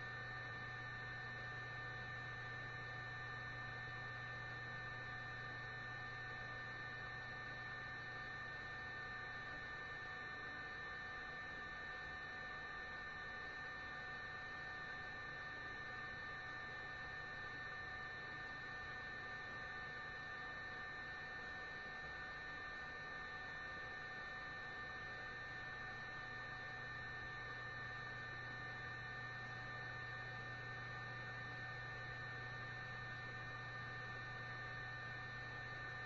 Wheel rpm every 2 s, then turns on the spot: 0, 0, 0, 0, 0, 0, 0, 0, 0, 0, 0, 0, 0, 0, 0, 0, 0, 0.
none